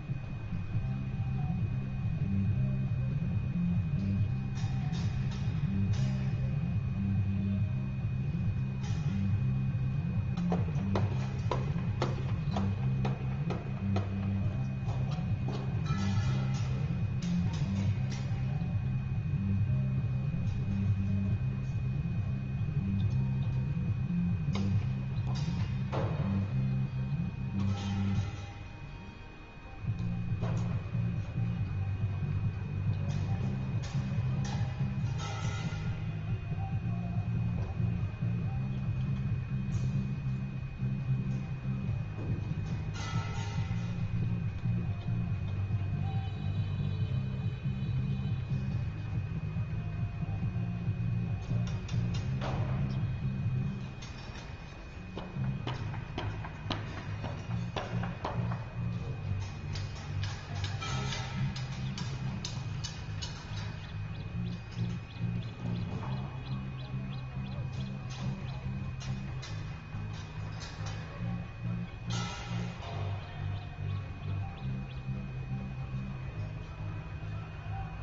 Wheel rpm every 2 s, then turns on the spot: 0, 0, 0, 0, 0, 0, 0, 0, 0, 0, 0, 0, 0, 0, 0, 0, 0, 0, 0, 0, 0, 0, 0, 0, 0, 0, 0, 0, 0, 0, 0, 0, 0, 0, 0, 0, 0, 0, 0.
none